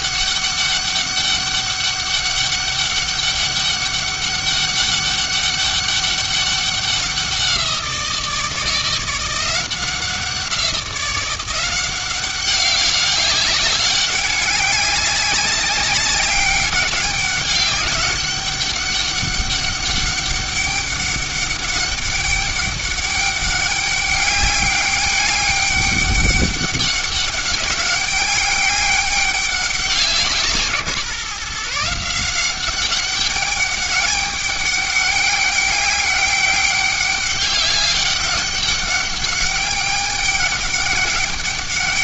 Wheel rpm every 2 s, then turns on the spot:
200, 200, 200, 200, 160, 180, 200, 200, 200, 200, 200, 200, 200, 200, 200, 160, 190, 200, 200, 200, 200.
none